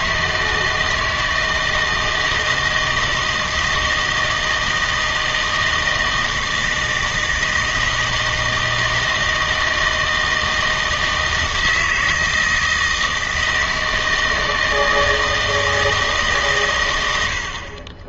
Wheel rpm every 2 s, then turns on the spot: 160, 160, 160, 160, 160, 160, 160, 160, 130.
none